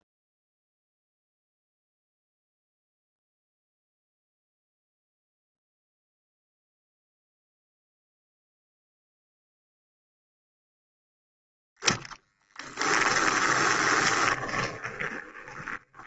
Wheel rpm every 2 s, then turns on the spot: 0, 0, 0, 0, 0, 0, 20, 20.
12-16